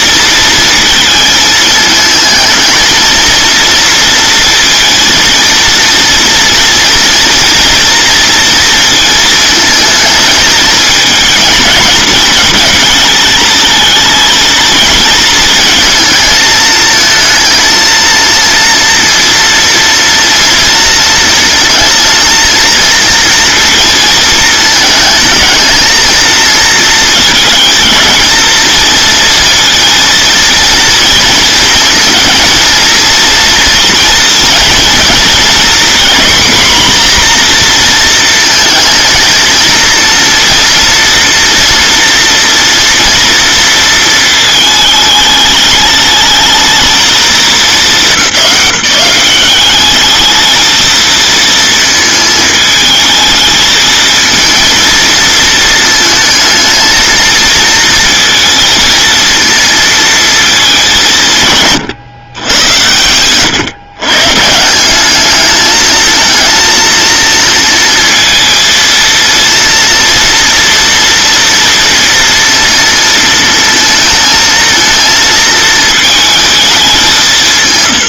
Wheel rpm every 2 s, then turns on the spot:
230, 220, 230, 230, 230, 220, 230, 230, 220, 230, 230, 230, 220, 220, 230, 230, 230, 230, 250, 230, 230, 230, 220, 210, 200, 230, 220, 230, 220, 220, 200, 100, 170, 230, 230, 230, 230, 230, 200.
none